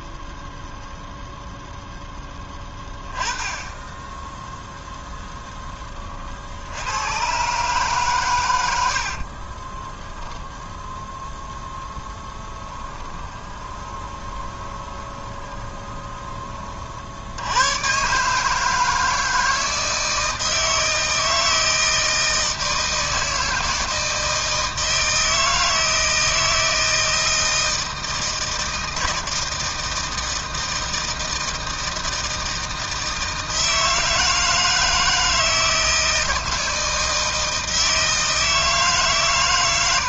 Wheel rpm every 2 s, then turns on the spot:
0, 10, 0, 90, 70, 0, 20, 20, 50, 160, 160, 160, 160, 160, 160, 160, 160, 160, 160, 150.
12-16